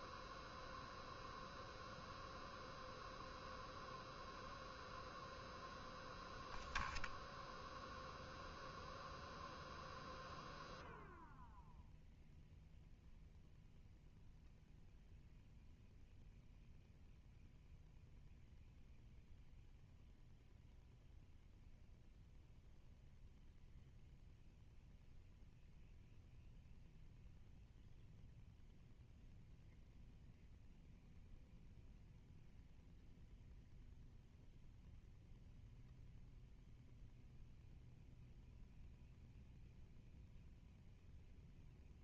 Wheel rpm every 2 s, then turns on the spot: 0, 0, 0, 0, 0, 0, 0, 0, 0, 0, 0, 0, 0, 0, 0, 0, 0, 0, 0, 0, 0.
none